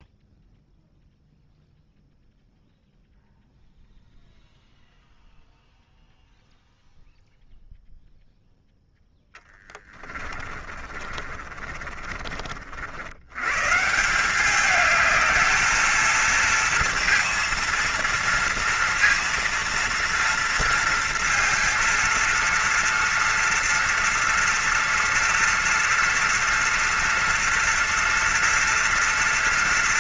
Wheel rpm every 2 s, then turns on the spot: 0, 0, 0, 0, 10, 40, 70, 210, 230, 230, 230, 230, 240, 230, 230.
8-12